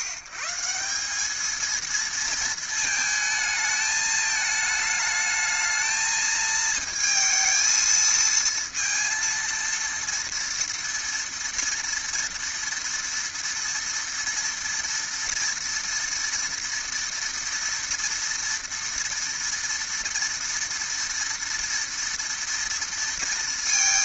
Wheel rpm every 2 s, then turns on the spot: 140, 220, 220, 220, 230, 230, 230, 230, 230, 230, 230, 230.
none